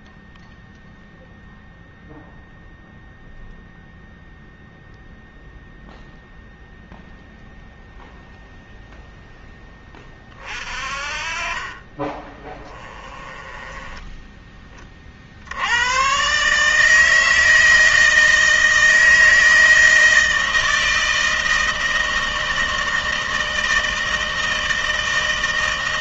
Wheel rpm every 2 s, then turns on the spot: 0, 0, 0, 0, 0, 40, 20, 30, 140, 160, 160, 160, 160.
10-14